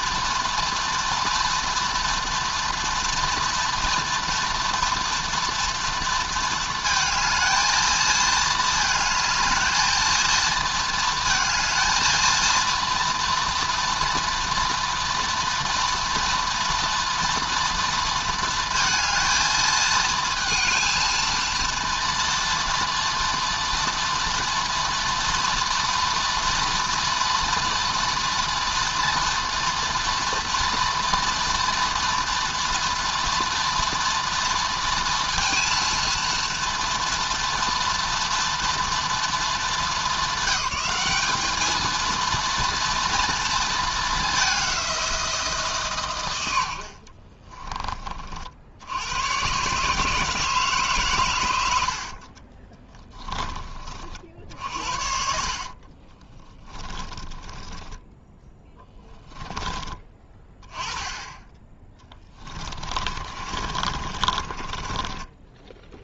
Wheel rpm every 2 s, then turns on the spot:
240, 230, 230, 230, 220, 220, 230, 230, 230, 230, 230, 230, 240, 230, 240, 230, 230, 230, 230, 230, 200, 230, 200, 80, 60, 160, 50, 60, 30, 10, 20, 20, 40.
52-60 62-66